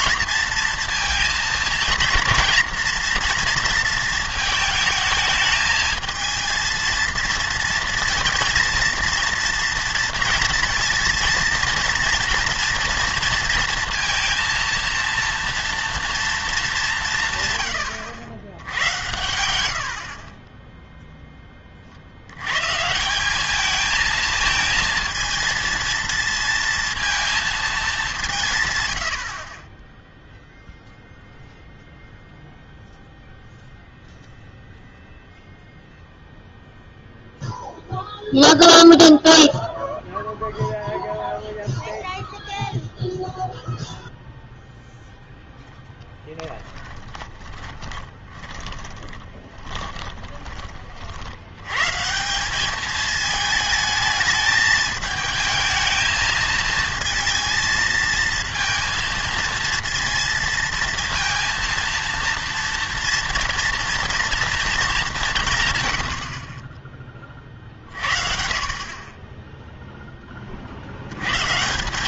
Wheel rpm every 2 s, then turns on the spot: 230, 230, 220, 220, 230, 230, 230, 230, 200, 90, 10, 130, 230, 230, 130, 0, 0, 0, 0, 0, 0, 0, 0, 10, 20, 30, 190, 220, 220, 230, 230, 230, 230, 30, 50, 50.
46-50